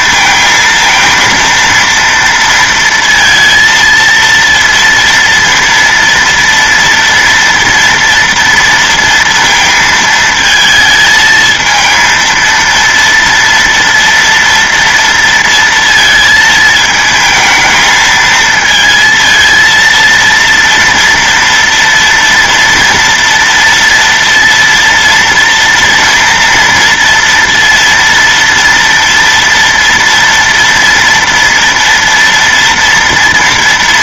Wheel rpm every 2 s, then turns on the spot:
220, 230, 230, 230, 230, 220, 230, 230, 220, 220, 230, 230, 230, 230, 230, 230, 230.
none